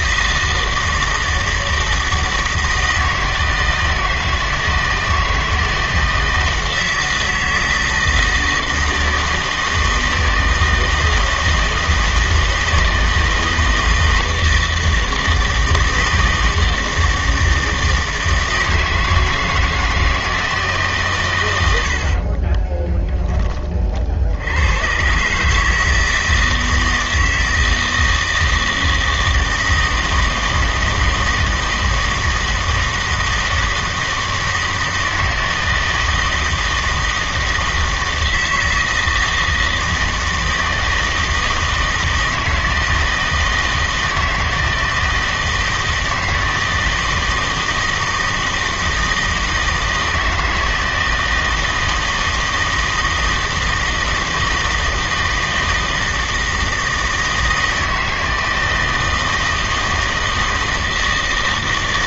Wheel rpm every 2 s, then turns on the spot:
160, 160, 160, 160, 160, 160, 160, 160, 160, 160, 150, 10, 110, 160, 160, 160, 160, 160, 160, 160, 160, 160, 160, 160, 160, 160, 160, 160, 160, 160, 160.
22-24